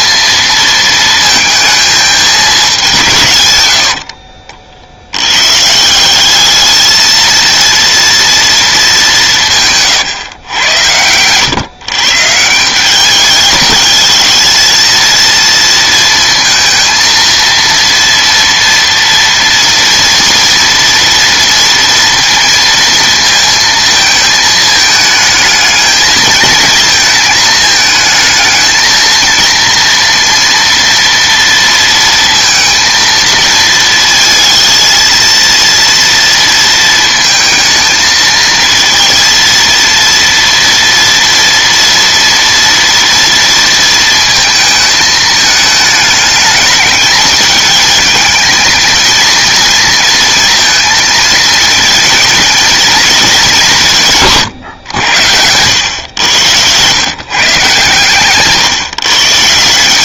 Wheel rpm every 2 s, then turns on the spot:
230, 210, 50, 210, 230, 110, 170, 220, 230, 230, 240, 230, 220, 220, 220, 230, 230, 220, 230, 220, 230, 230, 220, 210, 220, 230, 230, 130, 110, 150.
none